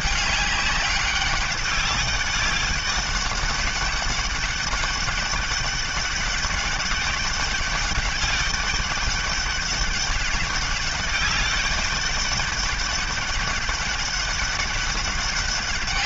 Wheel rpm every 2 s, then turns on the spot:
200, 200, 200, 200, 200, 200, 200, 200.
none